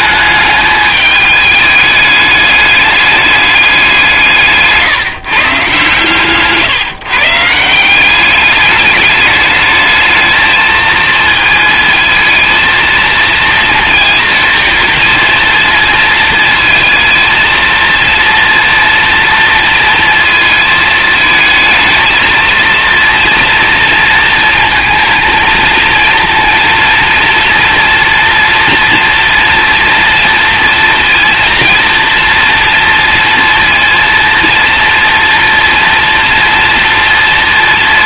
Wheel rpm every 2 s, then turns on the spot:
210, 210, 150, 140, 200, 220, 220, 230, 220, 240, 220, 230, 230, 230, 230, 230, 230, 230, 230.
none